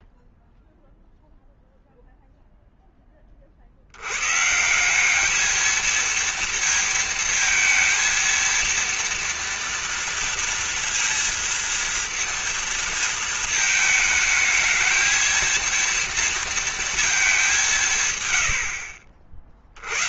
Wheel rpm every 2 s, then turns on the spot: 0, 0, 170, 230, 230, 230, 230, 220, 230, 70.
none